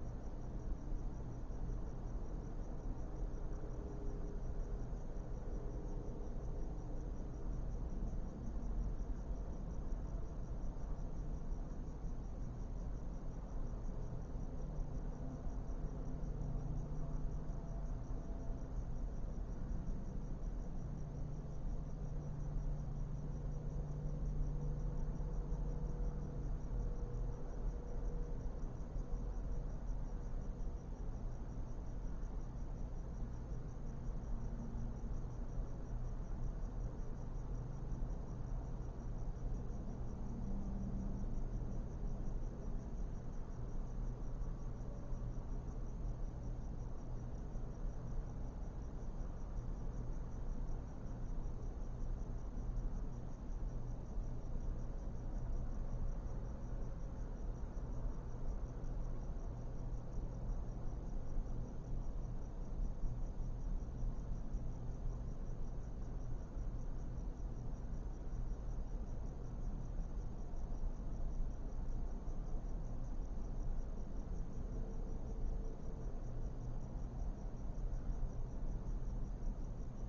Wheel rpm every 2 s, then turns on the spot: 0, 0, 0, 0, 0, 0, 0, 0, 0, 0, 0, 0, 0, 0, 0, 0, 0, 0, 0, 0, 0, 0, 0, 0, 0, 0, 0, 0, 0, 0, 0, 0, 0, 0, 0, 0, 0, 0, 0, 0.
none